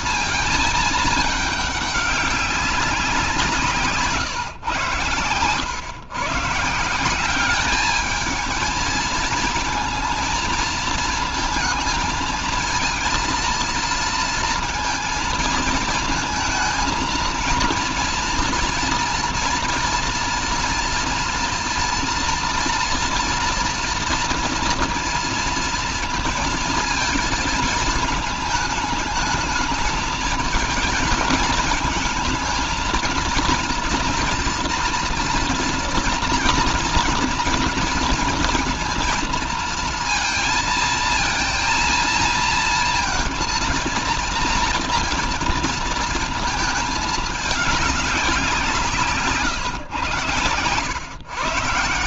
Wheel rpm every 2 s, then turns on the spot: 220, 190, 120, 150, 220, 230, 230, 230, 230, 230, 230, 230, 230, 230, 220, 220, 220, 240, 230, 230, 230, 230, 230, 220, 180, 120.
none